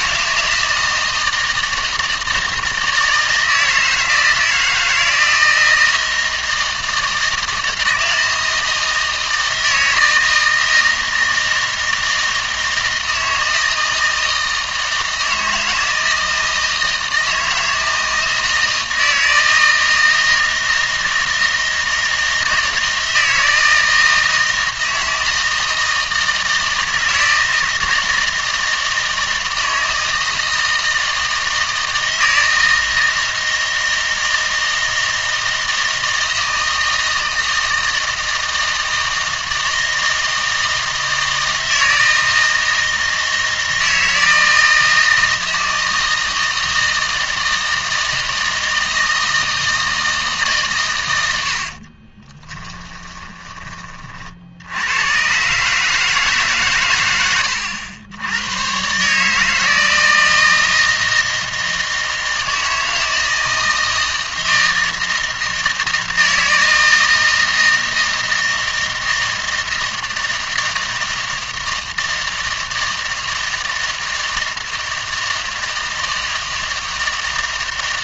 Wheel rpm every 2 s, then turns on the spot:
160, 160, 160, 160, 160, 160, 160, 160, 160, 160, 160, 160, 160, 160, 160, 160, 160, 160, 160, 160, 160, 160, 160, 160, 160, 120, 10, 80, 120, 120, 160, 160, 160, 160, 160, 160, 160, 160, 160.
52-54